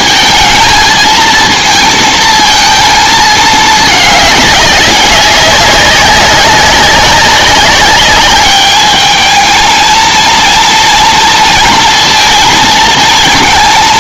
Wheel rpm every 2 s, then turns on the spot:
220, 230, 200, 200, 210, 230, 220.
none